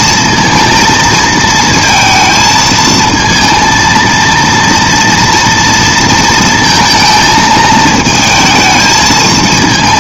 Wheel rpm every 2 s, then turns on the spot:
230, 220, 230, 220, 220.
none